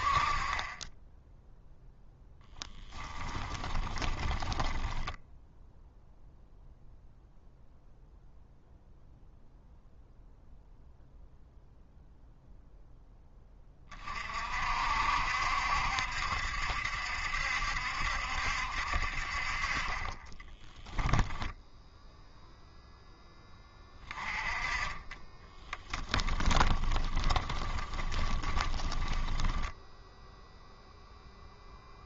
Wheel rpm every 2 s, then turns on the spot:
20, 10, 10, 0, 0, 0, 0, 60, 70, 60, 10, 0, 20, 20, 20, 0.
2-6 20-22 26-30